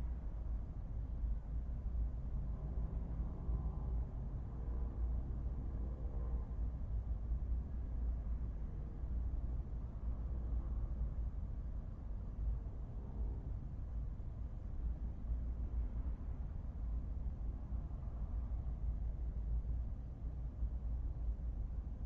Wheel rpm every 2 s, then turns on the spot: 0, 0, 0, 0, 0, 0, 0, 0, 0, 0, 0.
none